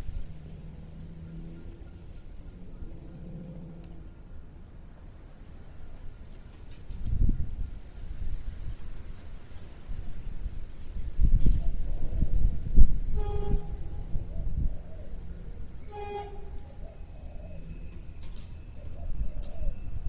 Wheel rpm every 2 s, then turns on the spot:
0, 0, 0, 0, 0, 0, 0, 0, 0, 0.
none